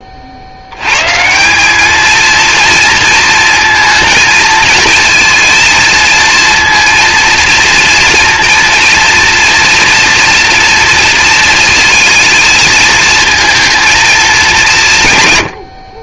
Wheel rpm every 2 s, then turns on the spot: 90, 230, 230, 230, 230, 240, 220, 170.
none